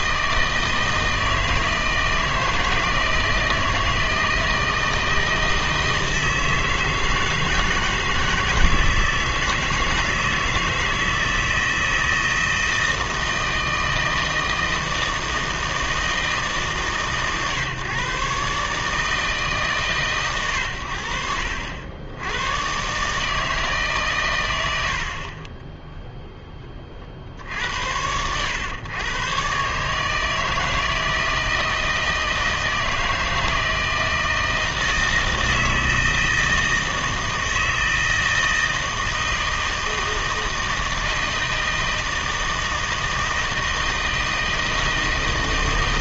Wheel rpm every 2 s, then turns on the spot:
160, 160, 160, 160, 160, 160, 160, 160, 150, 140, 100, 110, 100, 20, 110, 160, 160, 160, 160, 160, 160, 160, 160.
none